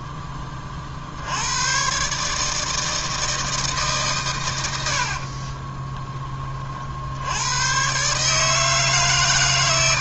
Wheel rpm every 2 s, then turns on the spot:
20, 150, 120, 30, 150.
none